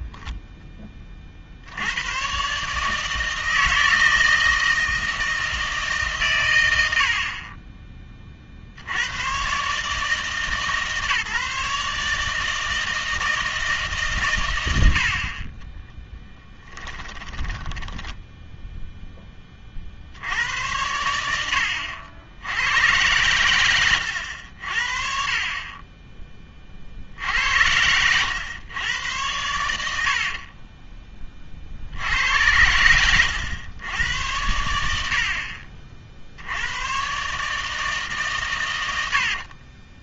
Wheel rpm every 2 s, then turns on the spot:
0, 140, 160, 110, 70, 150, 160, 70, 10, 0, 90, 90, 60, 40, 100, 30, 100, 80, 90, 140.
16-18 30-32